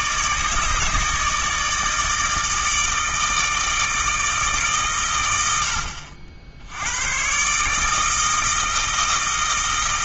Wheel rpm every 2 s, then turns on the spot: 150, 160, 140, 90, 160.
none